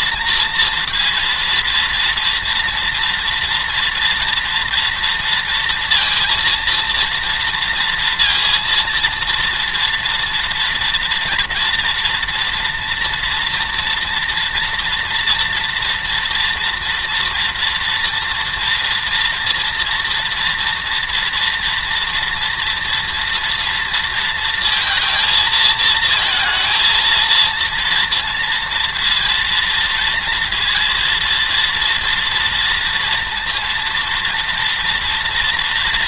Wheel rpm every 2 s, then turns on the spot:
230, 230, 230, 230, 230, 230, 240, 230, 230, 230, 240, 230, 230, 230, 230, 230, 230, 230.
none